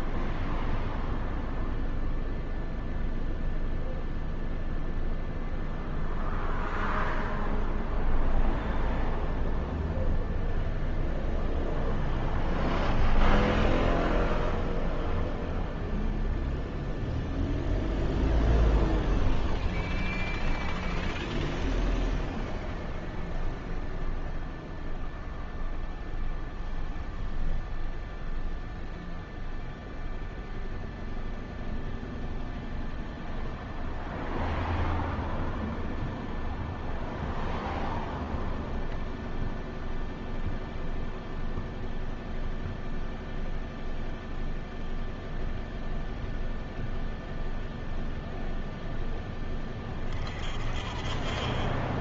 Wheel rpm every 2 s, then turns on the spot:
0, 0, 0, 0, 0, 0, 0, 0, 0, 0, 0, 0, 0, 0, 0, 0, 0, 0, 0, 0, 0, 0, 0, 0, 0, 30.
none